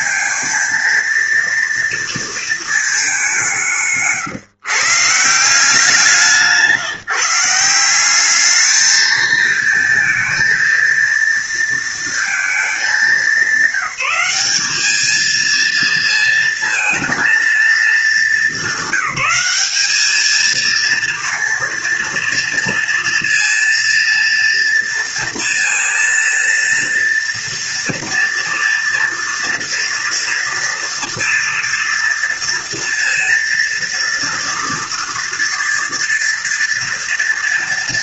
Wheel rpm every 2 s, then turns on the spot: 230, 220, 140, 160, 210, 230, 220, 200, 230, 200, 230, 230, 230, 230, 230, 230, 230, 230, 230.
none